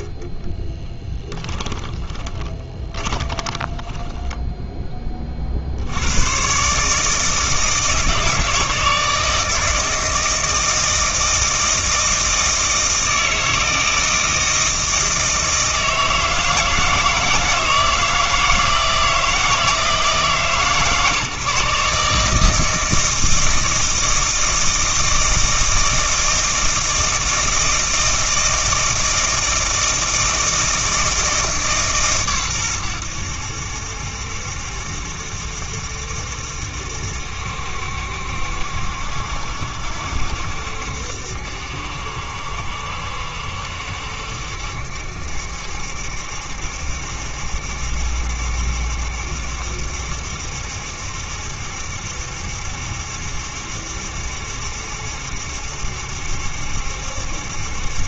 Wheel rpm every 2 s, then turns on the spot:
20, 20, 10, 140, 160, 160, 160, 160, 160, 160, 150, 160, 160, 160, 160, 160, 100, 70, 70, 70, 70, 70, 70, 70, 70, 70, 70, 70, 70.
0-4